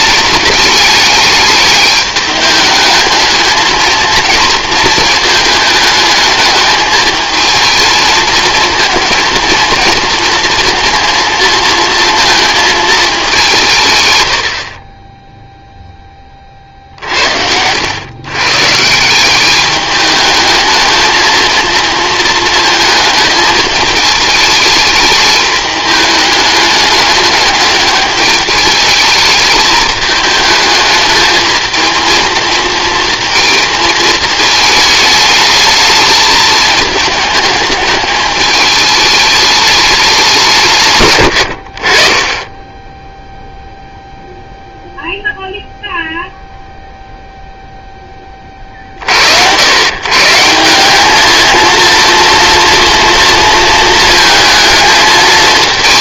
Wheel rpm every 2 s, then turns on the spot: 210, 210, 230, 210, 220, 230, 220, 60, 40, 140, 210, 230, 220, 210, 210, 220, 230, 220, 210, 210, 140, 10, 0, 0, 40, 170, 230, 220.
none